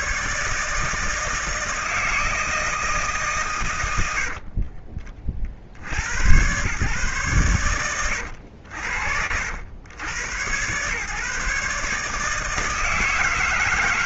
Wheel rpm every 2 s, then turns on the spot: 160, 150, 40, 130, 70, 130, 160.
none